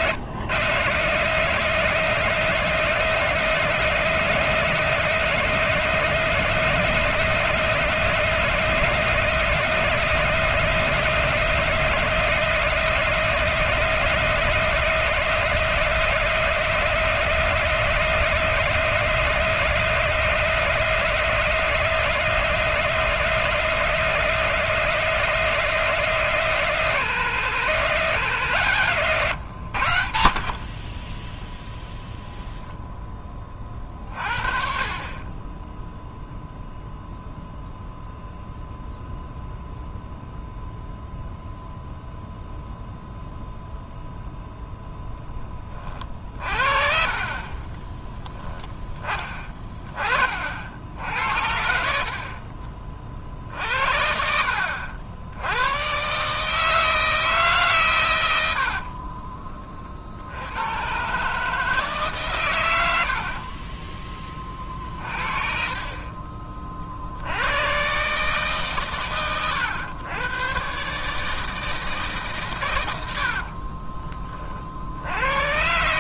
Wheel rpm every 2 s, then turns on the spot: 140, 180, 180, 180, 180, 180, 180, 180, 180, 180, 180, 180, 180, 180, 150, 30, 0, 40, 0, 0, 0, 0, 0, 40, 10, 60, 40, 70, 160, 60, 110, 90, 40, 40, 140, 130, 100, 60.
30-32 46-48 58-60